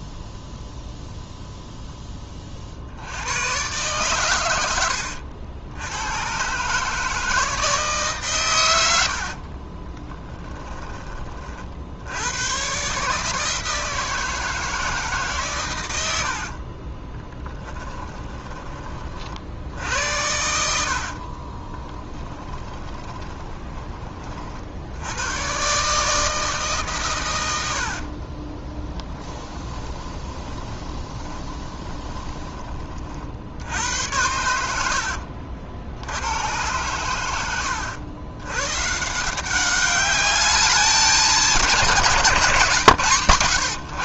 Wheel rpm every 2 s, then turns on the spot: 0, 70, 90, 150, 90, 20, 130, 160, 30, 40, 70, 20, 70, 150, 20, 20, 30, 80, 100, 130, 200, 150.
4-6 16-18 20-24 28-32